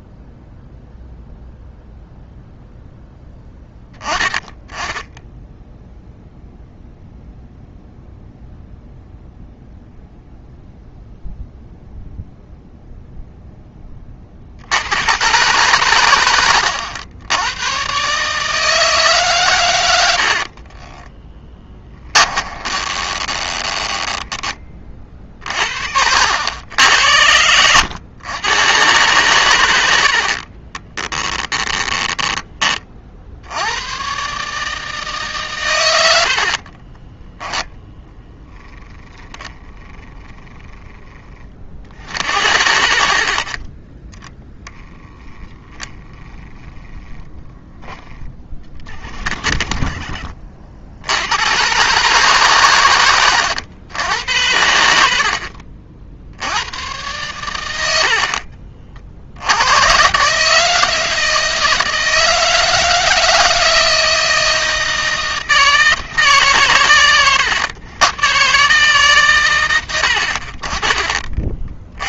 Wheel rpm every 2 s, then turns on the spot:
0, 0, 10, 0, 0, 0, 0, 100, 90, 150, 30, 20, 30, 80, 120, 20, 40, 150, 30, 10, 10, 70, 10, 10, 40, 70, 110, 80, 100, 50, 160, 160, 160, 130, 140, 30.
20-24 30-32 36-38